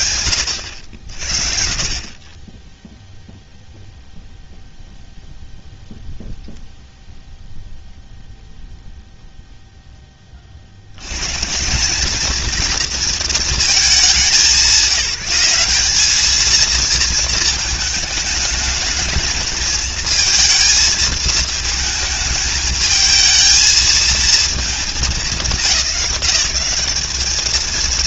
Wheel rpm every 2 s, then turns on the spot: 60, 0, 0, 0, 0, 120, 230, 190, 220, 220, 220, 220, 190, 210.
none